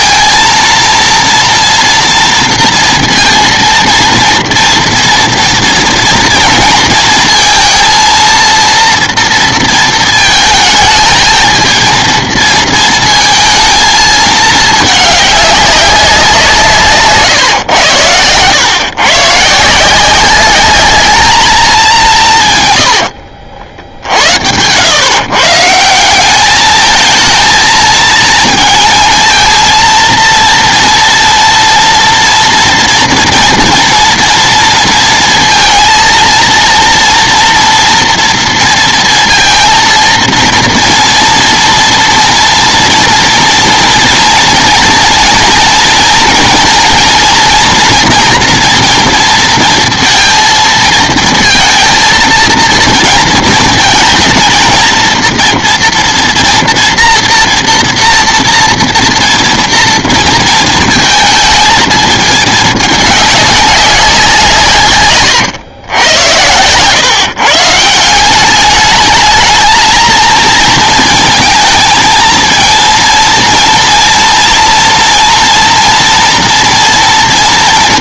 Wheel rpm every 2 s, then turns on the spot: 230, 230, 230, 230, 230, 220, 230, 210, 160, 130, 210, 90, 100, 220, 230, 230, 230, 230, 230, 230, 230, 240, 230, 230, 230, 230, 230, 230, 240, 230, 230, 210, 140, 130, 210, 230, 230, 230, 230.
22-24